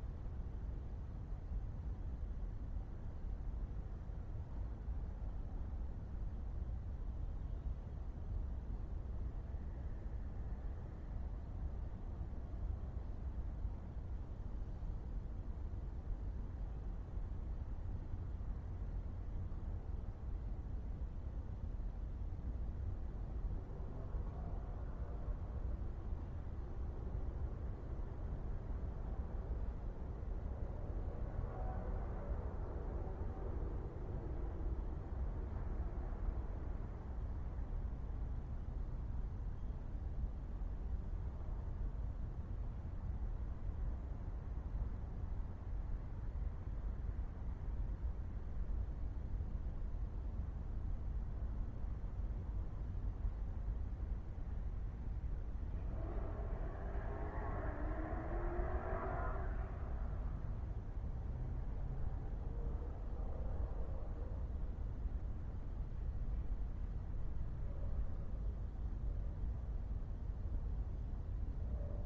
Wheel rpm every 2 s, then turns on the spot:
0, 0, 0, 0, 0, 0, 0, 0, 0, 0, 0, 0, 0, 0, 0, 0, 0, 0, 0, 0, 0, 0, 0, 0, 0, 0, 0, 0, 0, 0, 0, 0, 0, 0, 0, 0.
none